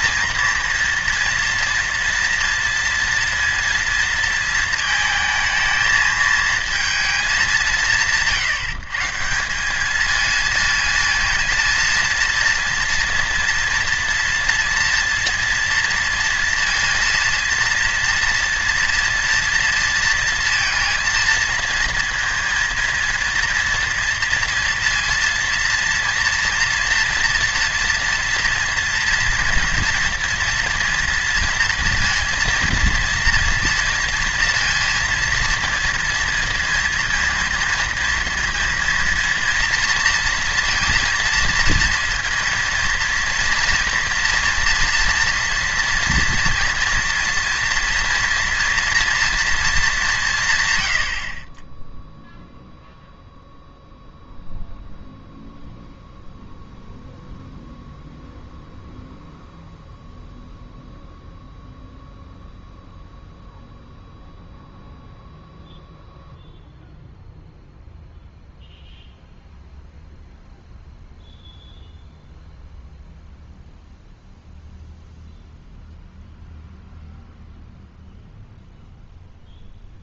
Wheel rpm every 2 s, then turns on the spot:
230, 230, 230, 220, 160, 230, 230, 230, 230, 230, 230, 230, 230, 230, 230, 230, 230, 230, 230, 230, 230, 230, 230, 230, 230, 130, 0, 0, 0, 0, 0, 0, 0, 0, 0, 0, 0, 0, 0, 0.
none